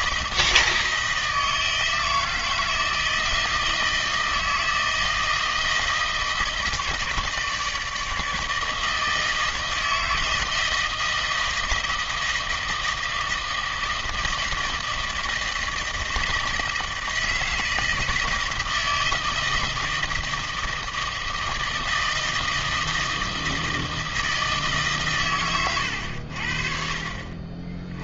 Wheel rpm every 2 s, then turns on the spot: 160, 160, 160, 160, 160, 160, 160, 160, 160, 160, 160, 160, 150, 60.
none